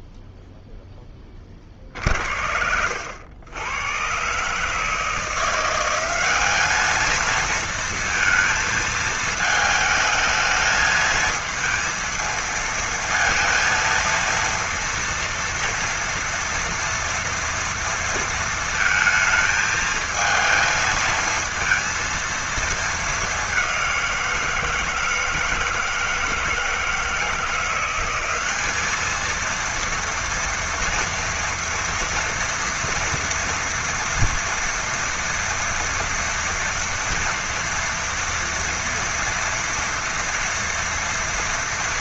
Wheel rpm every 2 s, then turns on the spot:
0, 70, 140, 200, 220, 220, 230, 230, 230, 220, 220, 220, 170, 160, 200, 230, 230, 230, 240, 230, 230.
none